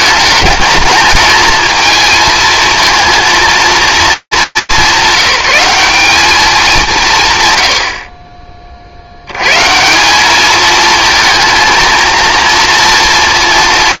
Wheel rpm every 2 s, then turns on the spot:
210, 230, 200, 190, 50, 220, 230.
none